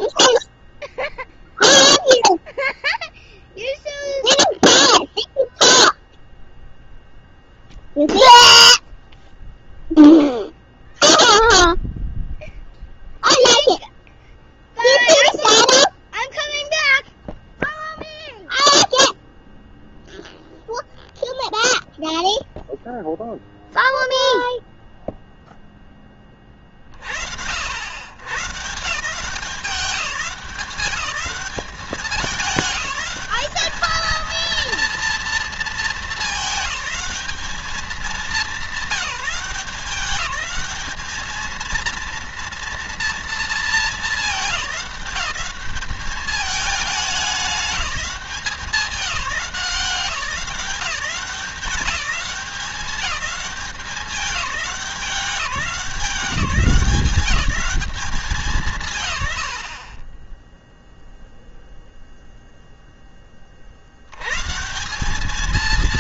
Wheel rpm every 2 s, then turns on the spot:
0, 0, 0, 0, 0, 0, 0, 0, 0, 0, 0, 0, 0, 40, 140, 200, 210, 230, 210, 200, 210, 230, 210, 210, 180, 170, 190, 200, 180, 160, 0, 0, 140.
none